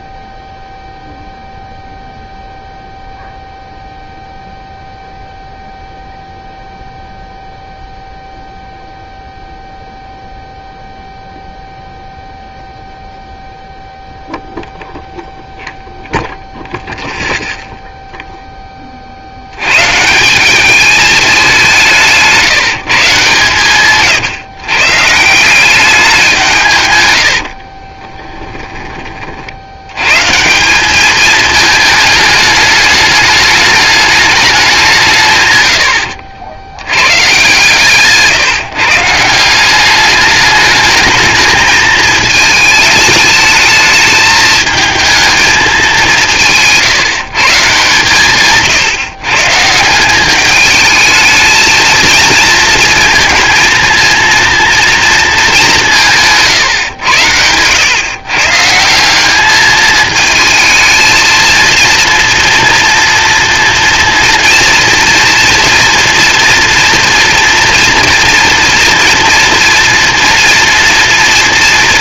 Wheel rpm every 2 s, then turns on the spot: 0, 0, 0, 0, 0, 0, 0, 0, 0, 20, 200, 150, 140, 150, 20, 190, 210, 190, 90, 140, 210, 220, 220, 150, 140, 210, 230, 230, 130, 170, 220, 230, 230, 230, 230, 230.
none